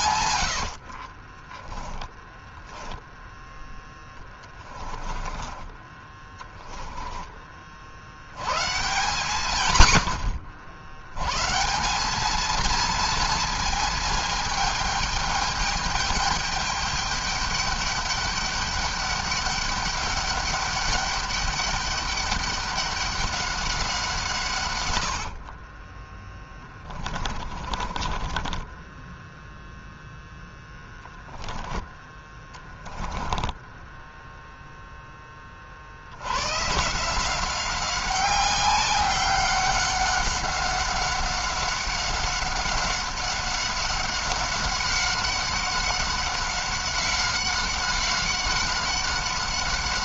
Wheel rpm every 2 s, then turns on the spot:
70, 10, 20, 20, 120, 90, 220, 220, 210, 200, 200, 200, 140, 20, 20, 0, 10, 0, 120, 190, 190, 190, 190, 190, 190.
0-8 26-30 32-34